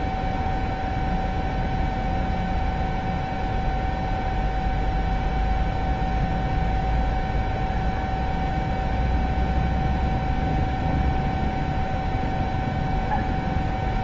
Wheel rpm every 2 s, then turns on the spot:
0, 0, 0, 0, 0, 0, 0.
none